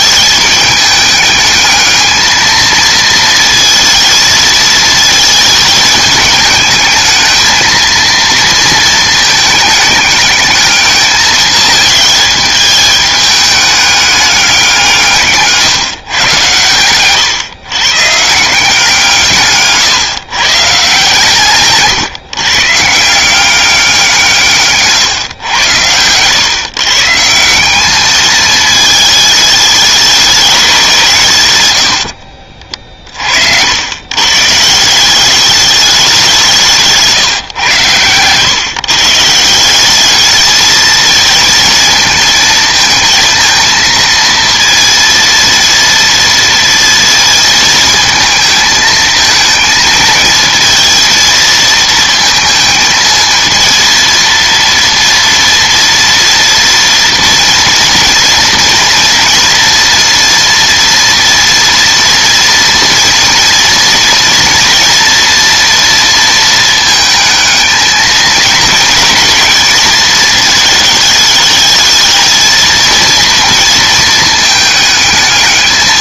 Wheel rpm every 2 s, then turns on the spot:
210, 230, 220, 220, 230, 210, 210, 180, 120, 160, 140, 150, 140, 130, 220, 180, 40, 160, 160, 140, 220, 220, 230, 230, 220, 230, 230, 230, 230, 230, 230, 230, 230, 220, 230, 220, 230, 220.
16-18